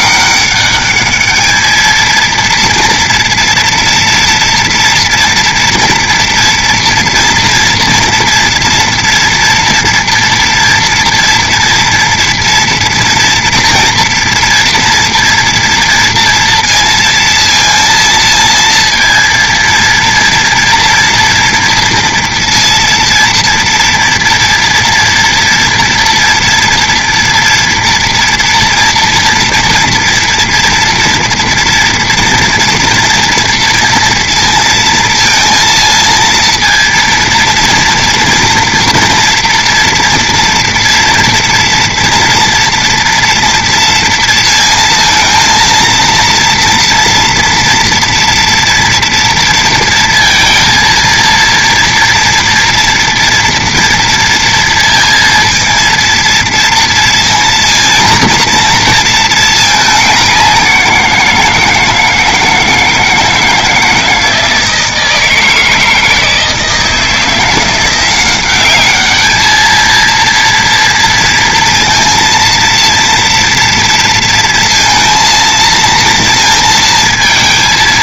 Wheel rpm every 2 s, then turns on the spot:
200, 230, 230, 240, 230, 230, 230, 240, 230, 230, 230, 230, 240, 230, 230, 230, 230, 230, 230, 230, 230, 230, 230, 230, 230, 230, 230, 230, 230, 230, 180, 160, 160, 160, 200, 230, 230, 230, 230.
none